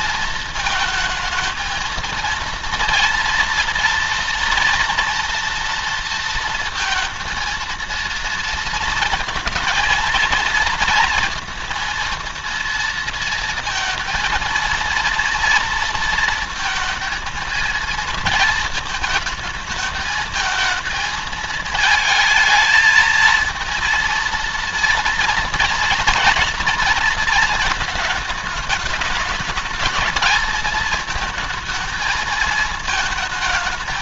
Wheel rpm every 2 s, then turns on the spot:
220, 230, 230, 230, 230, 230, 230, 230, 230, 220, 220, 220, 230, 230, 210, 220, 220.
none